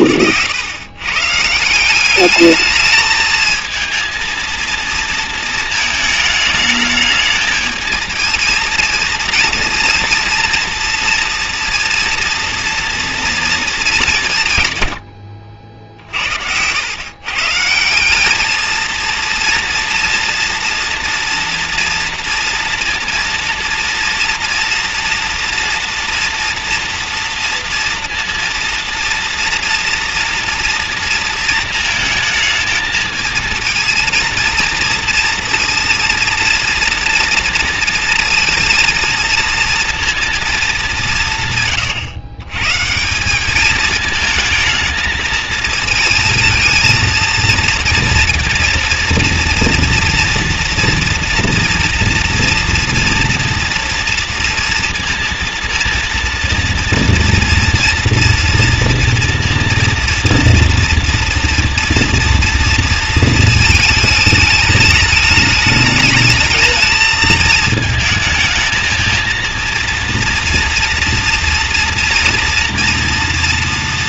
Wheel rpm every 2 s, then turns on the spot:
100, 210, 230, 220, 230, 230, 230, 140, 90, 220, 230, 230, 230, 240, 230, 230, 220, 230, 230, 230, 210, 130, 220, 220, 230, 230, 240, 230, 230, 240, 230, 230, 210, 220, 220, 230, 240.
none